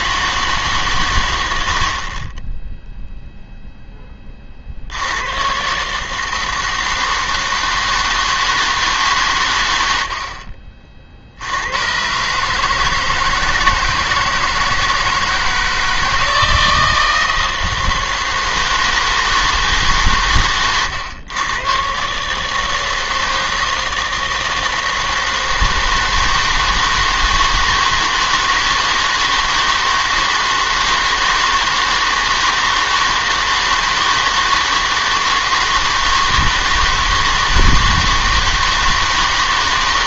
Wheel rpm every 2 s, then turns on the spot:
140, 0, 50, 160, 160, 50, 150, 160, 160, 160, 120, 160, 160, 160, 160, 160, 160, 160, 160, 160.
none